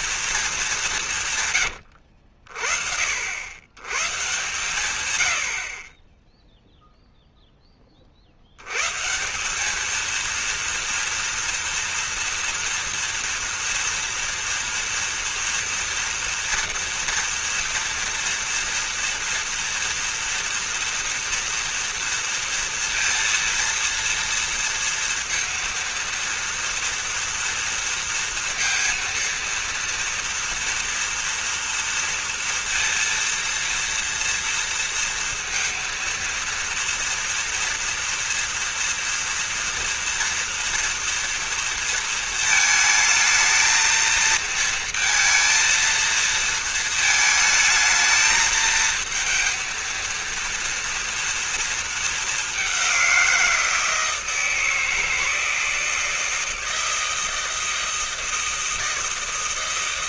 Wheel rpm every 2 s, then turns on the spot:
210, 60, 130, 0, 90, 230, 230, 230, 230, 230, 230, 230, 230, 230, 230, 230, 230, 230, 230, 230, 230, 220, 230, 220, 220, 230, 200, 160, 160, 160.
none